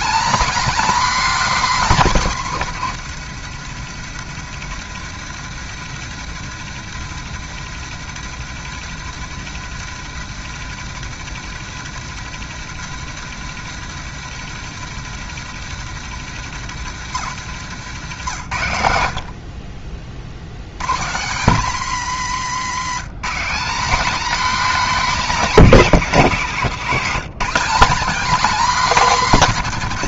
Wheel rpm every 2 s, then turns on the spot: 270, 180, 150, 150, 160, 150, 160, 150, 140, 90, 120, 170, 270, 180, 220.
none